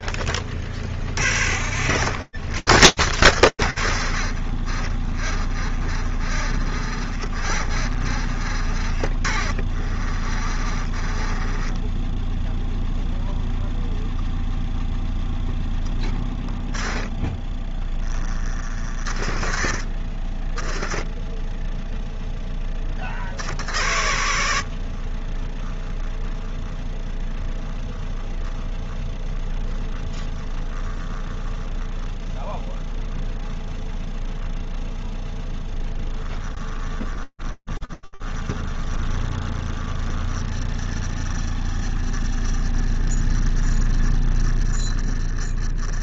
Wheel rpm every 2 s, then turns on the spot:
50, 80, 20, 40, 40, 20, 0, 0, 10, 50, 20, 40, 40, 20, 0, 10, 0, 0, 10, 20, 20, 20, 20.
none